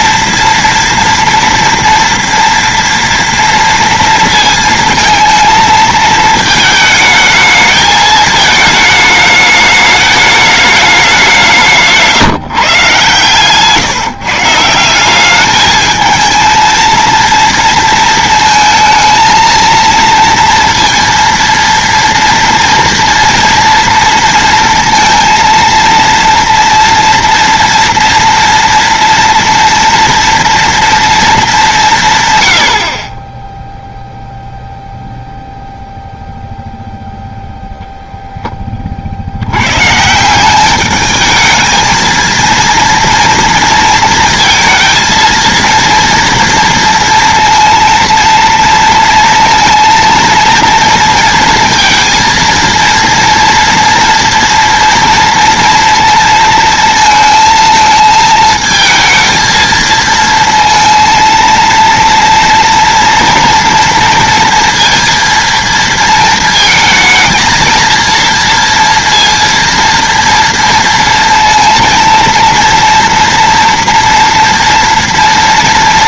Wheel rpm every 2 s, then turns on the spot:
230, 230, 230, 220, 220, 210, 150, 150, 220, 230, 230, 230, 230, 230, 230, 230, 170, 0, 0, 0, 160, 230, 230, 230, 230, 230, 230, 230, 230, 220, 230, 230, 230, 220, 230, 230, 230, 230.
none